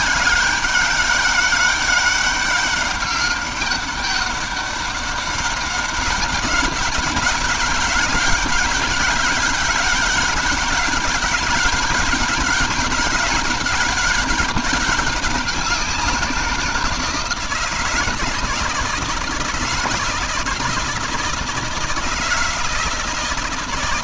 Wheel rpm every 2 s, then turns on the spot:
190, 190, 200, 190, 190, 200, 200, 200, 180, 160, 160, 160.
none